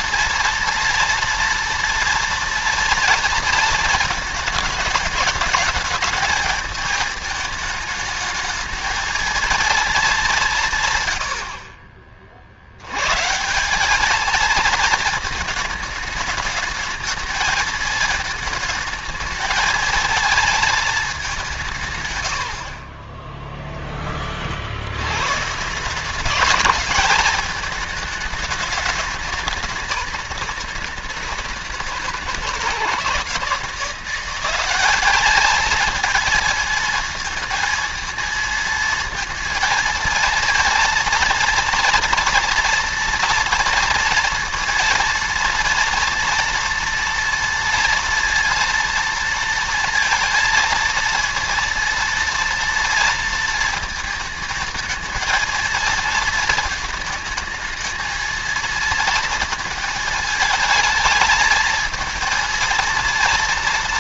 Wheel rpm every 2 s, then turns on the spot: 230, 230, 220, 220, 220, 110, 110, 220, 220, 220, 210, 30, 90, 210, 200, 150, 160, 200, 230, 230, 230, 230, 230, 230, 230, 230, 230, 230, 220, 230, 220, 230.
none